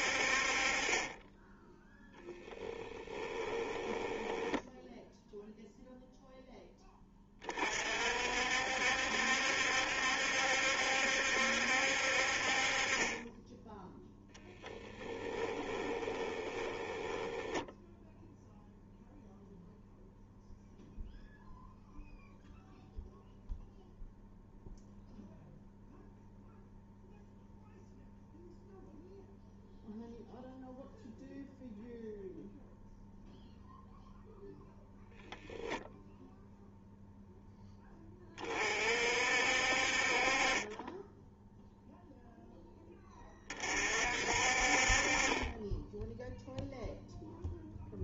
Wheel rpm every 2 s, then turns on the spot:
30, 10, 0, 10, 60, 70, 30, 20, 10, 0, 0, 0, 0, 0, 0, 0, 0, 0, 0, 40, 20, 10, 40, 0.
2-4 14-18